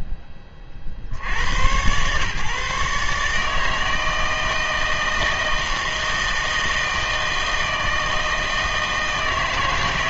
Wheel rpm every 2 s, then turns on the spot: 40, 140, 160, 160, 160.
none